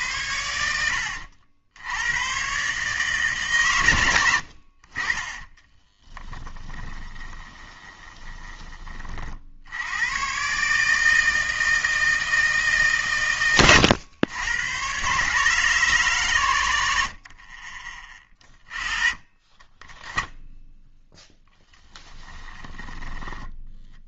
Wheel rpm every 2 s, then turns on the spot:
80, 130, 60, 10, 30, 140, 160, 110, 100, 20, 0, 10.
0-2 6-8